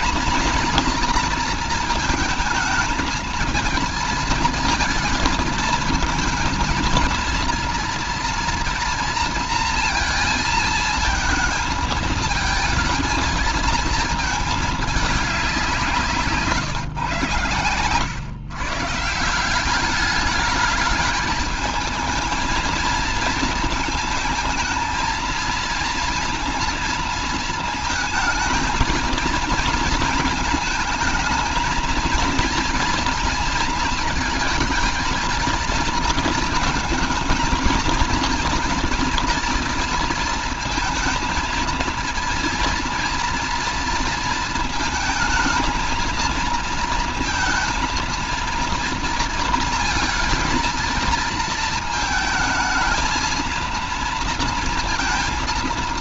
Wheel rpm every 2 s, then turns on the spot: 230, 220, 220, 220, 230, 220, 220, 220, 130, 150, 210, 220, 230, 230, 230, 220, 230, 220, 230, 240, 230, 230, 220, 230, 230, 230, 220, 230.
none